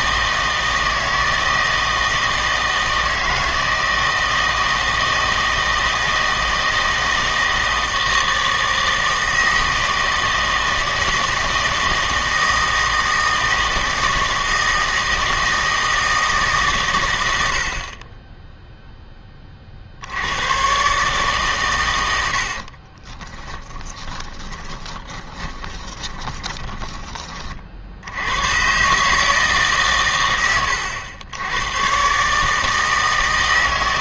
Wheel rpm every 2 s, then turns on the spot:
160, 160, 160, 160, 160, 160, 160, 160, 130, 0, 130, 40, 20, 20, 120, 100, 160.
22-28